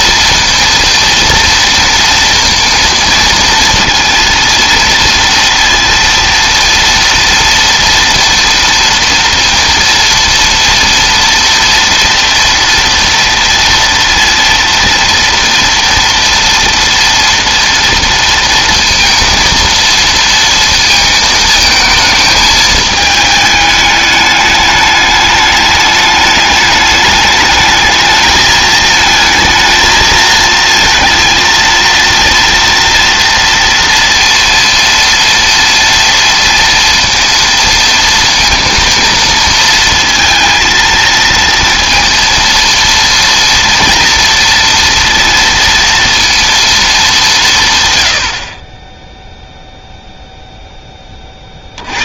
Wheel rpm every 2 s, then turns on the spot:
230, 230, 230, 230, 230, 230, 240, 230, 230, 230, 230, 220, 210, 210, 220, 220, 230, 230, 230, 230, 230, 230, 230, 230, 50, 0.
none